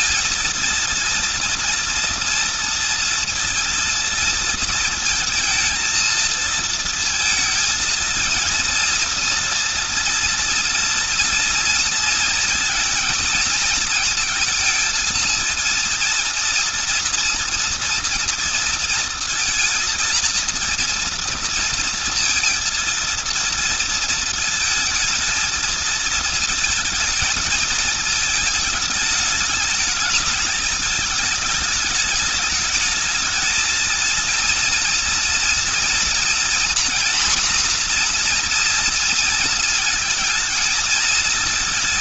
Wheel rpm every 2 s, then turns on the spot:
230, 230, 230, 230, 230, 230, 230, 230, 230, 230, 230, 230, 220, 220, 210, 210, 210, 230, 230, 230, 230.
none